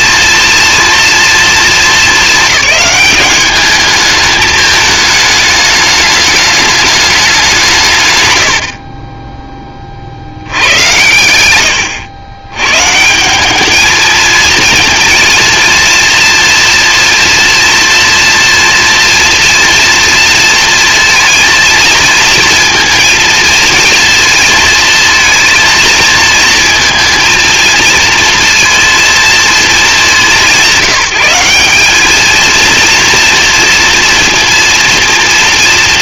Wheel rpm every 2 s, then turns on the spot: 240, 210, 210, 210, 50, 110, 140, 230, 230, 240, 230, 230, 230, 230, 230, 180, 230, 230.
none